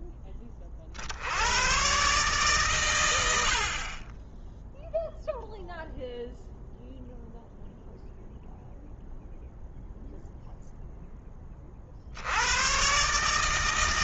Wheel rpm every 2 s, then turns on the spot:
40, 120, 0, 0, 0, 0, 110.
none